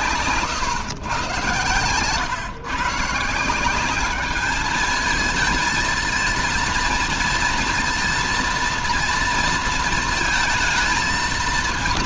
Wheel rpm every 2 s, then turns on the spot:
120, 150, 220, 230, 230, 220.
none